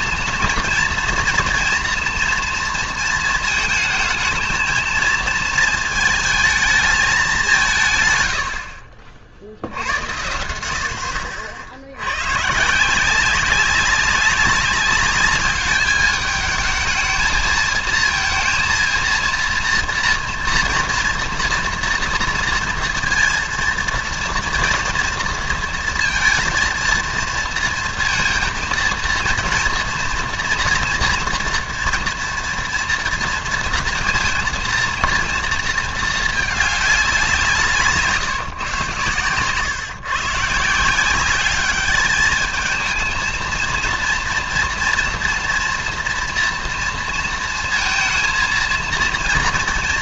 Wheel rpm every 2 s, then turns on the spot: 230, 230, 220, 210, 70, 80, 140, 200, 220, 230, 230, 230, 230, 230, 230, 230, 230, 230, 210, 130, 160, 220, 230, 230, 230.
none